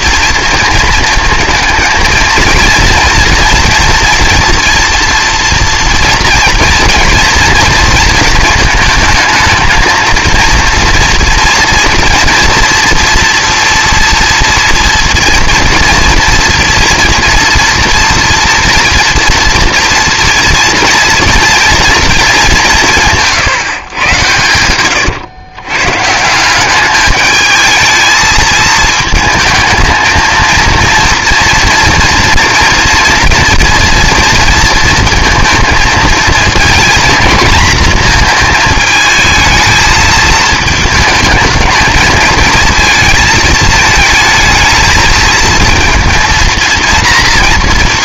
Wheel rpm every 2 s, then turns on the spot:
230, 230, 230, 230, 220, 230, 240, 230, 230, 230, 230, 180, 100, 190, 220, 230, 230, 230, 240, 220, 220, 220, 220, 230.
24-26